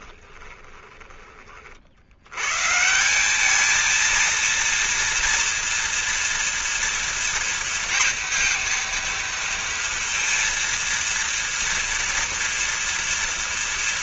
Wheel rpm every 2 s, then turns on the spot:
10, 120, 230, 230, 230, 230, 230.
0-2